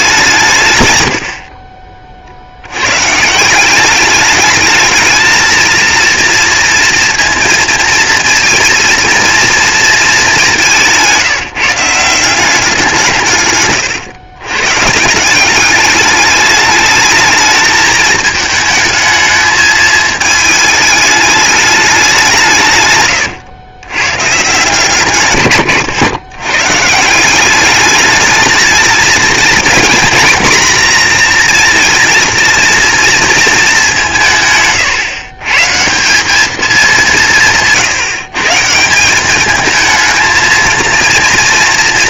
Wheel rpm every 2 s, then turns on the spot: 150, 70, 210, 230, 230, 200, 180, 130, 210, 220, 220, 150, 140, 120, 220, 240, 230, 150, 210, 160, 230.
none